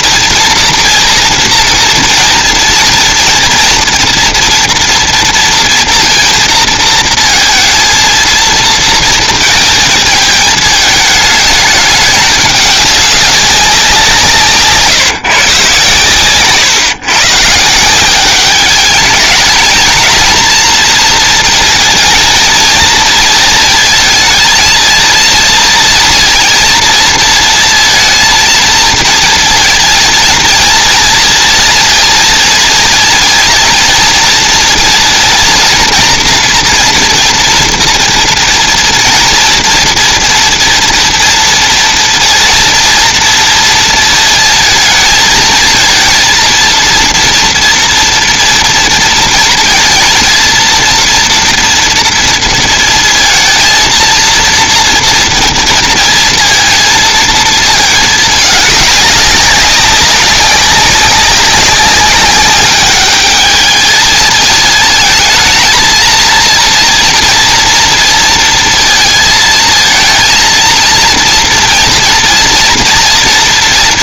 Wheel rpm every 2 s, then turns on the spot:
230, 230, 230, 230, 230, 220, 210, 150, 140, 200, 230, 230, 230, 230, 230, 230, 230, 230, 240, 230, 240, 230, 220, 230, 230, 230, 230, 230, 230, 210, 190, 200, 220, 230, 230, 230, 230.
14-16